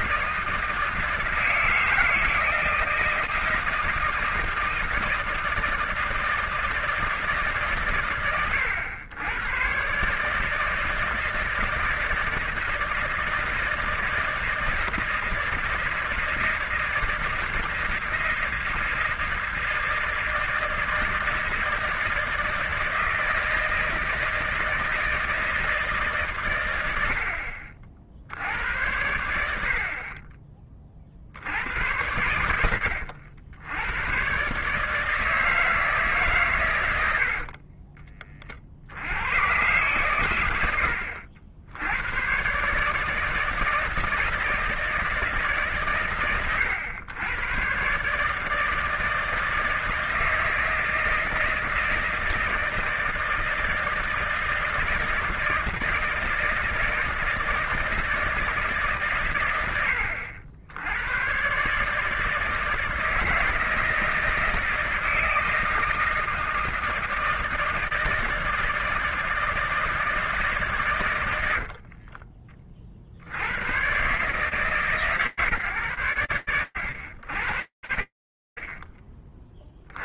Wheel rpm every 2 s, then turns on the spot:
160, 160, 160, 160, 110, 150, 160, 160, 160, 160, 160, 160, 160, 130, 70, 40, 90, 130, 140, 50, 100, 130, 160, 120, 150, 160, 160, 160, 160, 160, 90, 160, 160, 160, 160, 160, 40, 150, 100, 10.
72-74